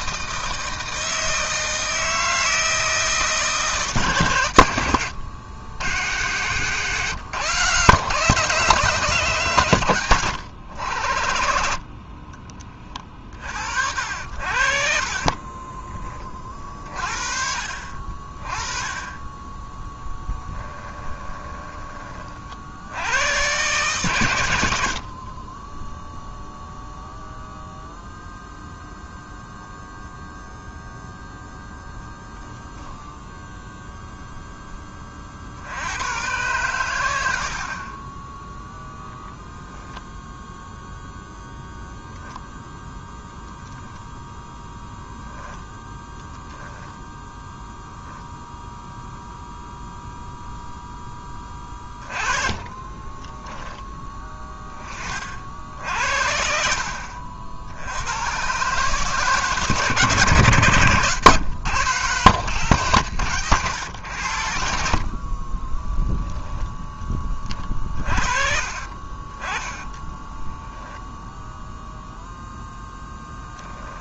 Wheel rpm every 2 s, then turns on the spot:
160, 160, 90, 130, 150, 80, 30, 50, 30, 20, 10, 80, 60, 0, 0, 0, 10, 20, 100, 10, 0, 0, 0, 0, 0, 0, 20, 20, 60, 130, 120, 150, 70, 10, 40, 10, 0.
20-22 24-26 52-54 68-72